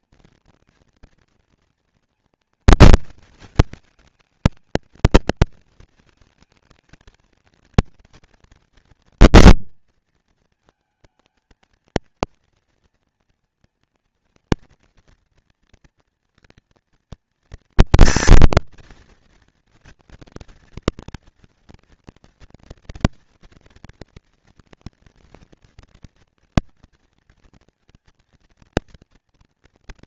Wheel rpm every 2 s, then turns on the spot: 230, 230, 220, 220, 230, 220, 230, 230, 230, 240, 230, 240, 230, 230, 230.
none